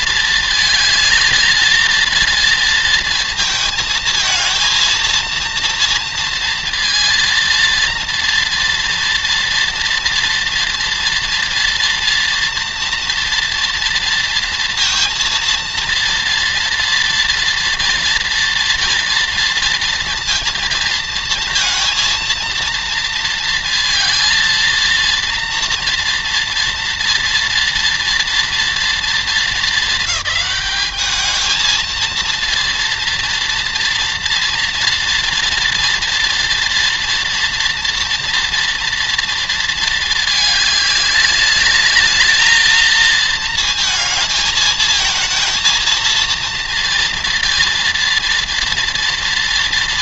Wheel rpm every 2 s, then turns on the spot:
220, 230, 220, 230, 240, 230, 230, 230, 230, 230, 230, 230, 230, 230, 230, 210, 230, 230, 230, 230, 210, 220, 220, 230, 230.
none